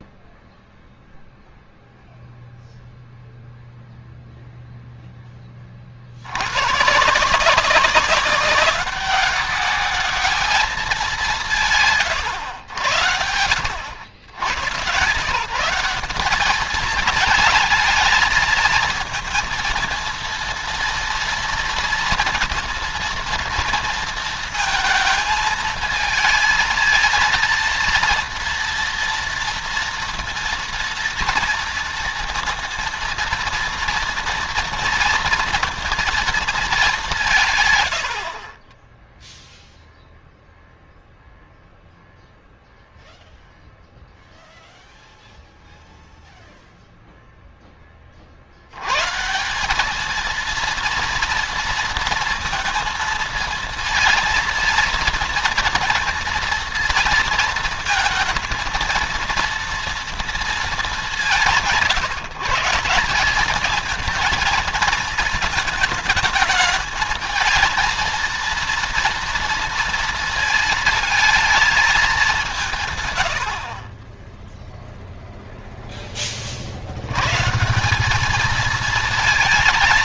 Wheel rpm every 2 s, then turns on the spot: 0, 0, 0, 140, 200, 210, 90, 120, 210, 220, 230, 230, 220, 220, 230, 230, 230, 230, 200, 10, 0, 0, 0, 0, 100, 230, 230, 230, 230, 220, 210, 180, 230, 220, 230, 230, 160, 0, 70, 220.
38-40